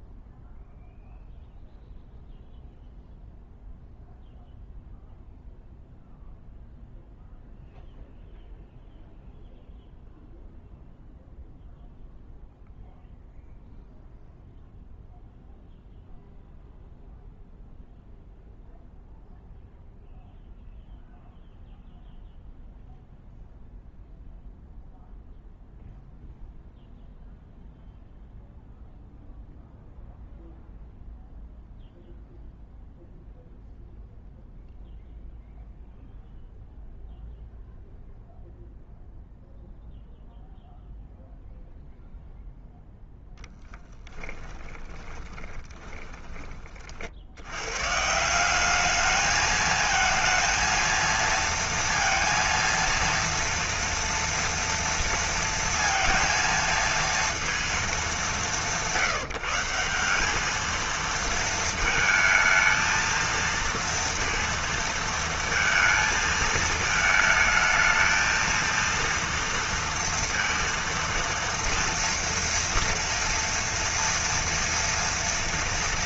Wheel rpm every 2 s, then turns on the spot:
0, 0, 0, 0, 0, 0, 0, 0, 0, 0, 0, 0, 0, 0, 0, 0, 0, 0, 0, 0, 0, 0, 10, 20, 160, 230, 230, 230, 230, 200, 200, 220, 230, 220, 230, 230, 230, 230.
44-48